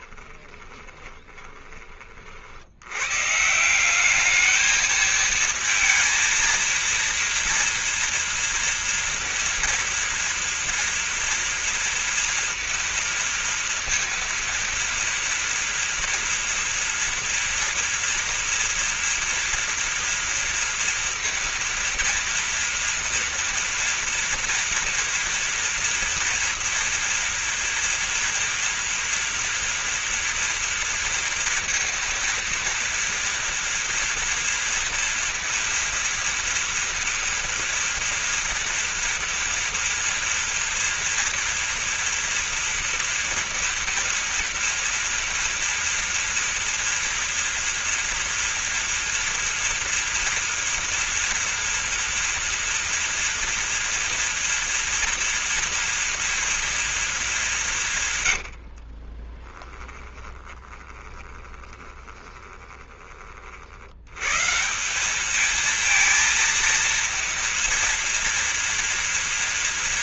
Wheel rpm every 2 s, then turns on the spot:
20, 80, 220, 230, 230, 230, 230, 230, 240, 230, 230, 230, 230, 230, 240, 230, 230, 230, 230, 230, 230, 230, 230, 230, 230, 230, 230, 230, 230, 70, 20, 20, 160, 230, 230.
0-2 58-64